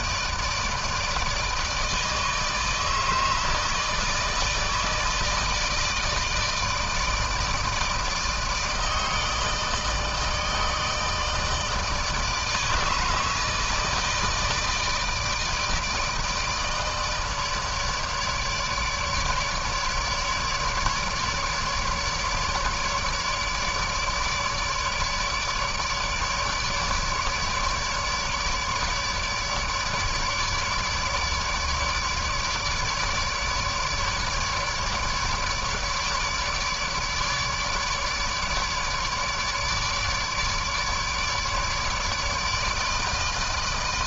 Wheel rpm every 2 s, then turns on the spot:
160, 150, 160, 160, 160, 160, 160, 160, 160, 150, 150, 150, 150, 150, 150, 150, 150, 150, 150, 150, 150, 150.
none